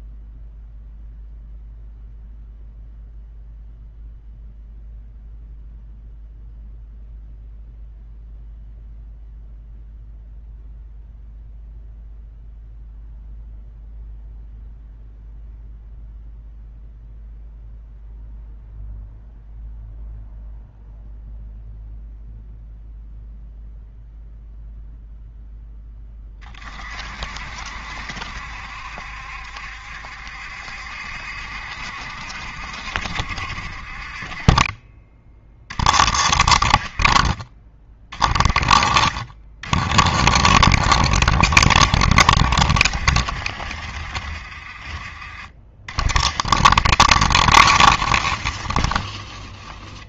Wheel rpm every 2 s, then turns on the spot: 0, 0, 0, 0, 0, 0, 0, 0, 0, 0, 0, 0, 0, 30, 70, 70, 60, 20, 40, 40, 60, 60, 40, 60, 30.
none